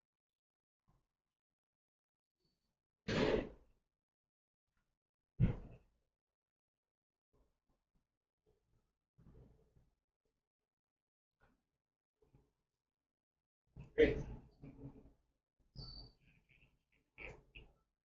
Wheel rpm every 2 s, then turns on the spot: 0, 0, 0, 0, 0, 0, 0, 0, 0.
none